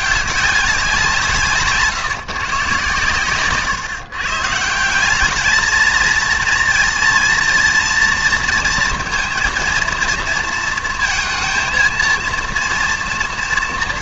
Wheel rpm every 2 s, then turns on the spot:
190, 140, 160, 230, 230, 230, 230.
none